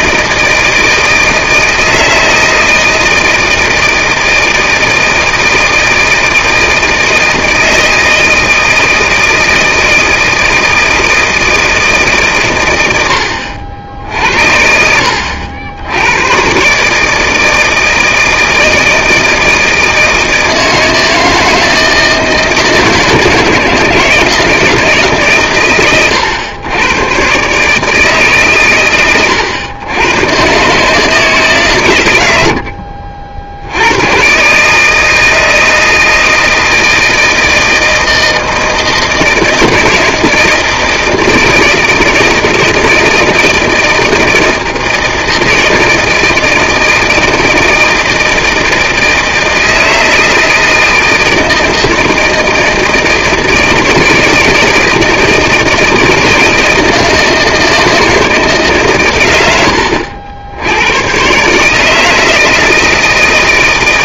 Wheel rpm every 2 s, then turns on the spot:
160, 160, 160, 160, 160, 160, 110, 60, 130, 160, 160, 160, 160, 100, 130, 140, 70, 150, 160, 160, 160, 160, 160, 160, 160, 160, 160, 160, 160, 150, 90, 170.
none